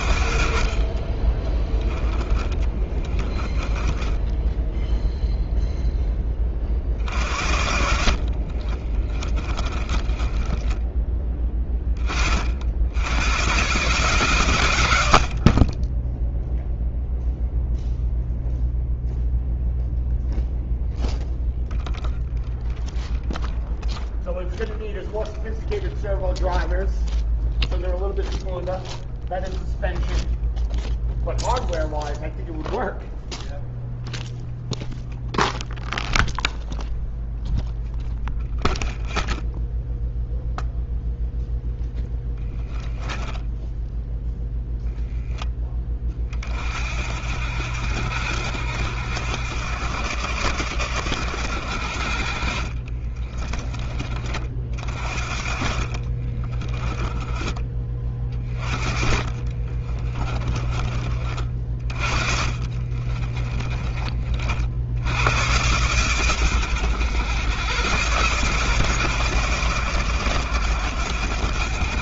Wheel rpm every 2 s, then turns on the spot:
50, 10, 10, 30, 50, 20, 60, 130, 10, 0, 0, 0, 0, 0, 0, 0, 0, 0, 0, 0, 0, 20, 0, 30, 70, 80, 50, 30, 30, 30, 40, 40, 40, 110, 120, 100.
2-6 8-12 42-44 52-54 56-64